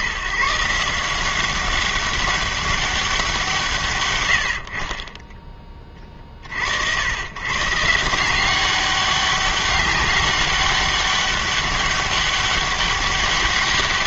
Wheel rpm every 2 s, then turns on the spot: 160, 200, 60, 50, 190, 200, 200.
4-6